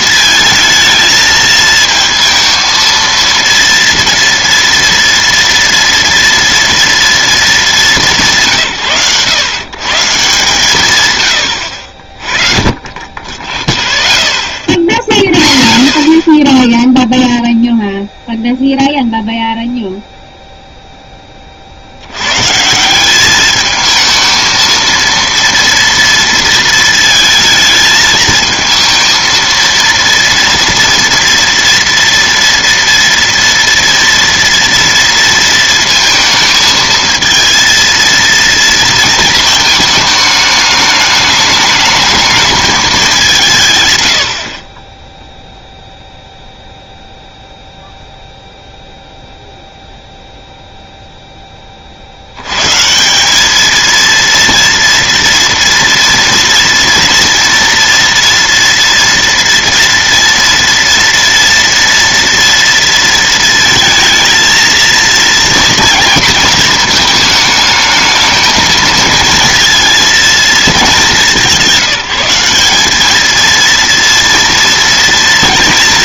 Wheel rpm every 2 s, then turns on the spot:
220, 230, 230, 230, 160, 140, 30, 0, 0, 0, 0, 160, 230, 230, 230, 230, 230, 230, 220, 230, 210, 200, 20, 0, 0, 0, 120, 230, 230, 230, 230, 230, 230, 230, 220, 220, 190, 230.
none